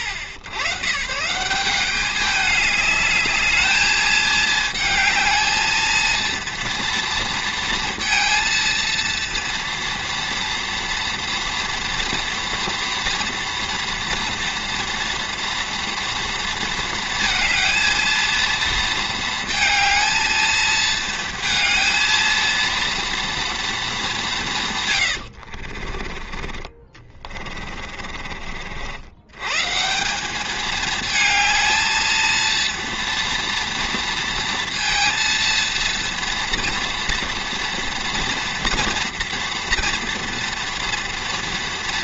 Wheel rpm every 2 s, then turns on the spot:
140, 200, 220, 230, 230, 230, 230, 230, 230, 230, 220, 230, 140, 30, 50, 210, 230, 230, 230, 230, 230.
26-28